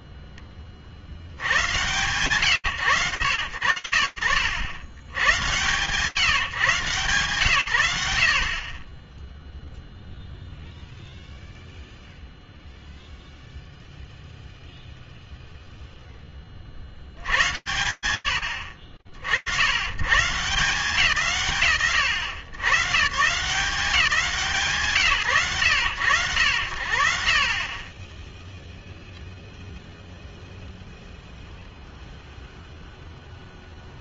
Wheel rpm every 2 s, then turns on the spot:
10, 110, 70, 140, 20, 0, 0, 0, 160, 80, 160, 150, 110, 40, 0, 0, 0.
none